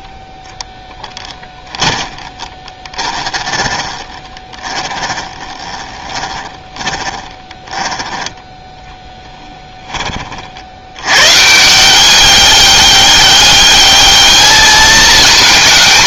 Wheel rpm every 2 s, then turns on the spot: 10, 20, 20, 20, 10, 80, 200, 220.
2-8